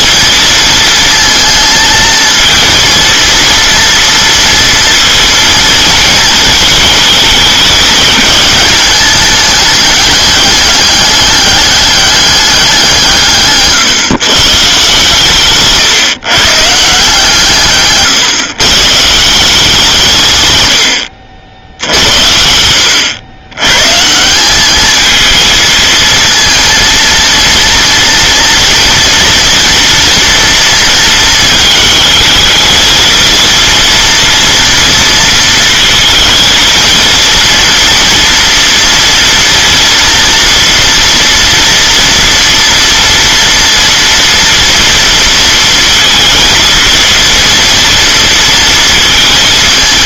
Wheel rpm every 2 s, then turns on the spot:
230, 230, 230, 220, 210, 210, 190, 140, 150, 140, 110, 90, 200, 230, 230, 230, 220, 230, 230, 230, 230, 230, 230, 230, 230.
none